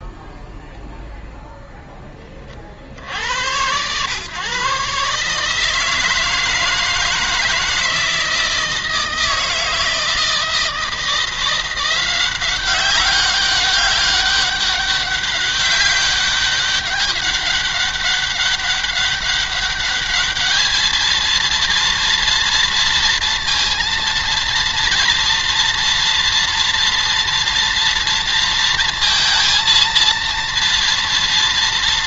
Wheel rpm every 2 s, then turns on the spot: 0, 40, 140, 160, 160, 160, 190, 200, 190, 200, 220, 230, 230, 230, 230, 230.
none